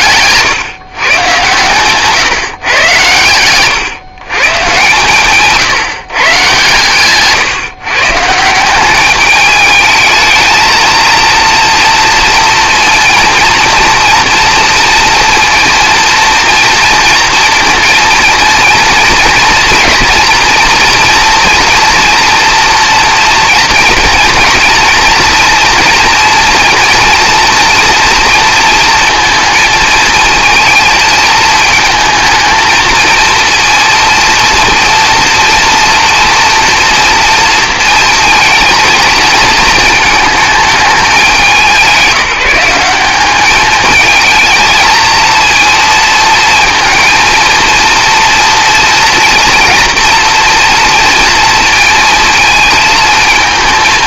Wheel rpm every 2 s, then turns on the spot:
140, 130, 130, 140, 180, 220, 230, 230, 230, 230, 240, 240, 230, 230, 230, 230, 220, 230, 230, 230, 220, 190, 220, 230, 230, 230, 230.
none